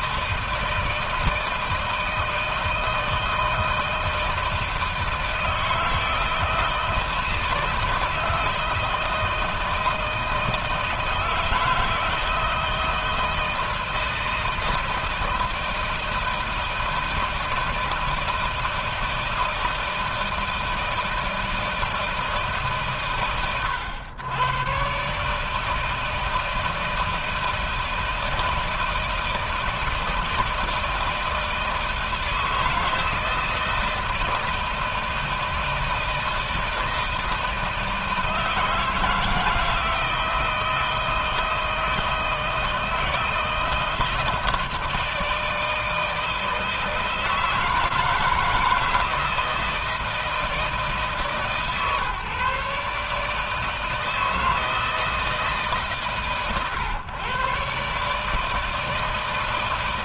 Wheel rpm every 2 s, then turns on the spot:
160, 160, 160, 160, 160, 160, 160, 160, 160, 160, 160, 150, 130, 160, 160, 160, 160, 160, 160, 160, 160, 160, 160, 160, 160, 150, 140, 160, 130, 160.
none